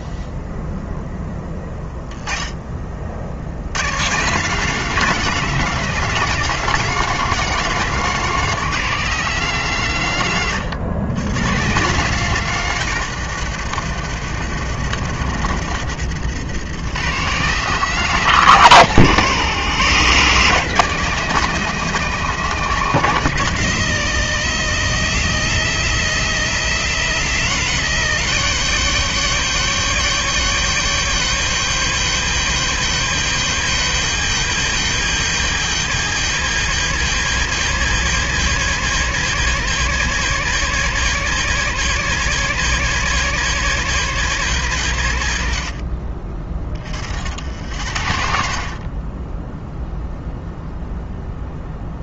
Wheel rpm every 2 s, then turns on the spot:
0, 30, 200, 210, 190, 130, 150, 100, 140, 140, 180, 170, 130, 150, 170, 180, 170, 170, 170, 180, 180, 180, 140, 40, 40, 0.
none